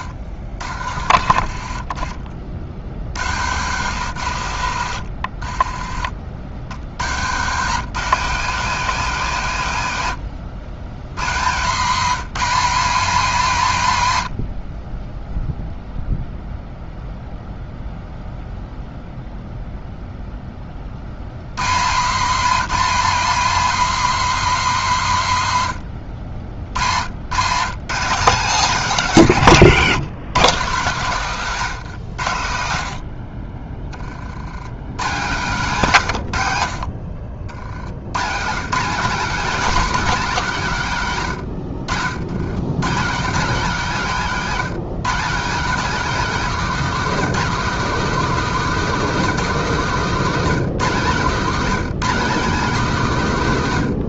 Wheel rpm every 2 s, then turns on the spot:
60, 50, 90, 70, 170, 100, 210, 60, 0, 0, 30, 220, 200, 80, 190, 160, 70, 110, 60, 190, 170, 130, 180, 220, 220, 180, 190.
none